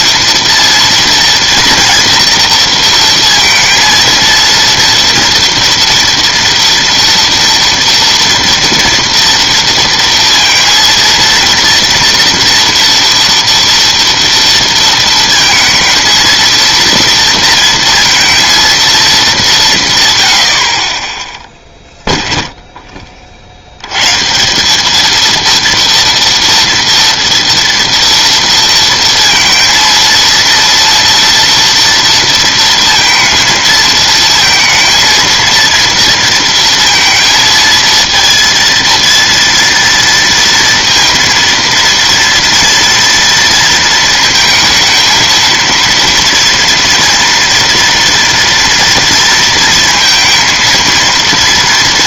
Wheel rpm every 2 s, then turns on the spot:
230, 230, 230, 230, 230, 230, 230, 230, 230, 220, 20, 10, 200, 230, 230, 230, 230, 230, 230, 230, 230, 230, 220, 230, 240, 230.
none